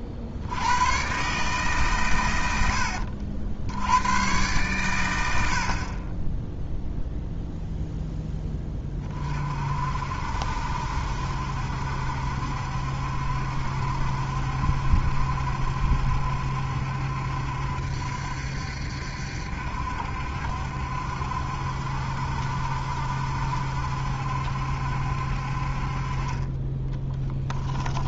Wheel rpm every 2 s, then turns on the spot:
70, 100, 100, 10, 10, 60, 70, 70, 70, 70, 70, 70, 70, 30.
none